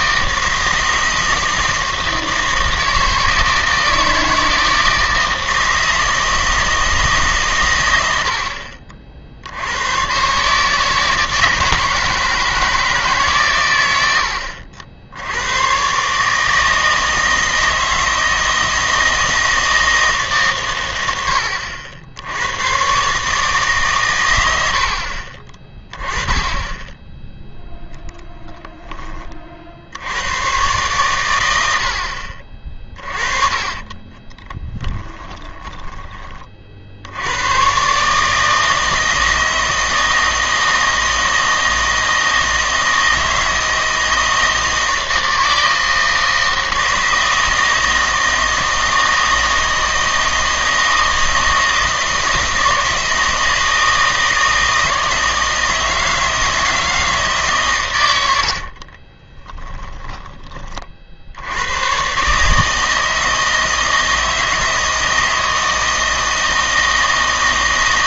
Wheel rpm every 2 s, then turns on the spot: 160, 160, 160, 160, 60, 150, 160, 70, 160, 160, 120, 120, 70, 10, 20, 110, 40, 10, 50, 160, 160, 160, 160, 160, 160, 160, 160, 160, 160, 50, 30, 150, 160, 160.
28-30 34-36 58-60